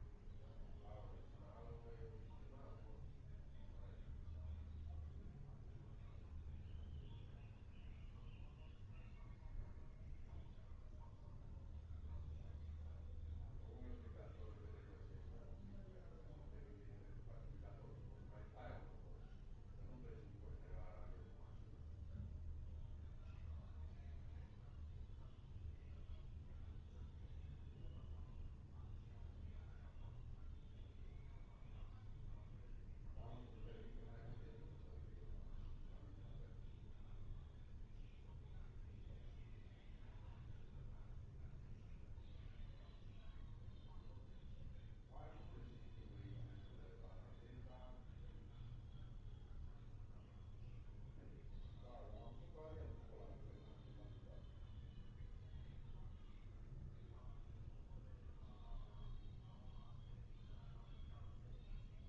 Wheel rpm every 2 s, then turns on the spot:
0, 0, 0, 0, 0, 0, 0, 0, 0, 0, 0, 0, 0, 0, 0, 0, 0, 0, 0, 0, 0, 0, 0, 0, 0, 0, 0, 0, 0, 0, 0.
none